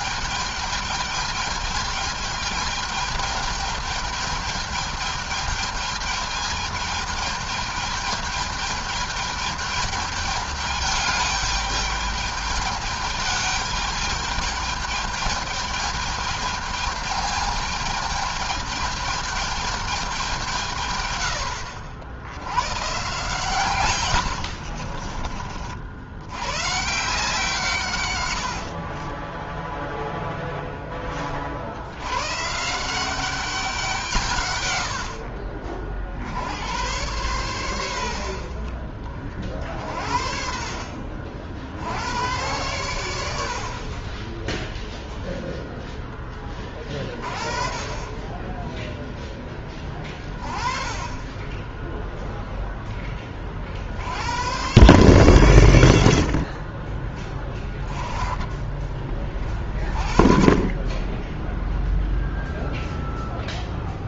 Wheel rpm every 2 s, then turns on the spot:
210, 220, 220, 220, 220, 210, 210, 220, 210, 210, 130, 110, 50, 140, 50, 10, 160, 90, 100, 50, 50, 100, 0, 30, 20, 20, 20, 120, 40, 20, 30, 0.
24-26 28-30 48-50